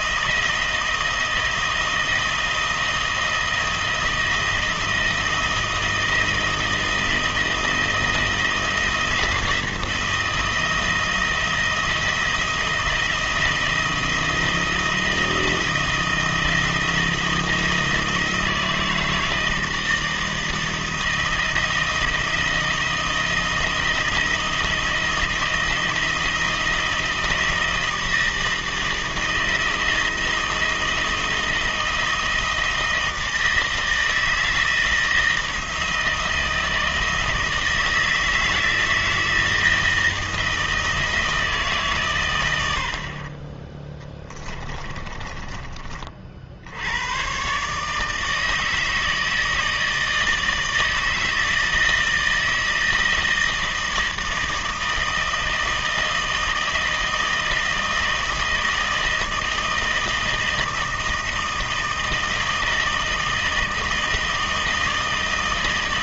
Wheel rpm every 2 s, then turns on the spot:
160, 160, 160, 160, 160, 160, 170, 160, 160, 160, 160, 160, 170, 160, 160, 160, 160, 160, 160, 160, 160, 70, 20, 90, 160, 160, 160, 160, 160, 160, 160, 160, 160.
44-46